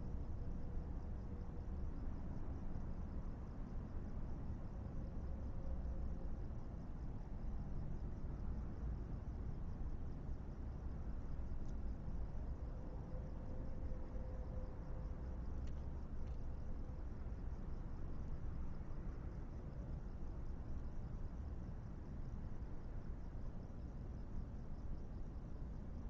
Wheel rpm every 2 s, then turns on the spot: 0, 0, 0, 0, 0, 0, 0, 0, 0, 0, 0, 0, 0.
none